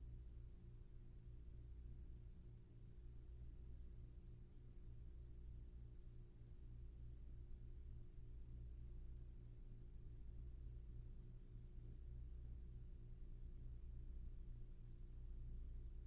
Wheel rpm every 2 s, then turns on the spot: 0, 0, 0, 0, 0, 0, 0, 0.
none